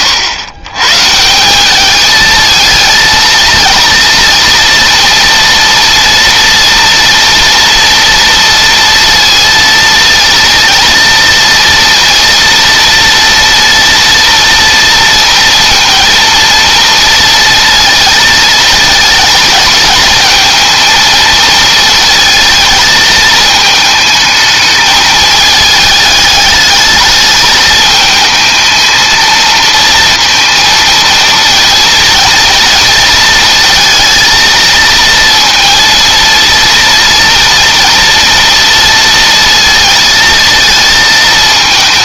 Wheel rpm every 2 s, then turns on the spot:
140, 230, 230, 230, 230, 230, 230, 230, 230, 220, 220, 220, 220, 210, 220, 230, 230, 230, 230, 230, 220.
none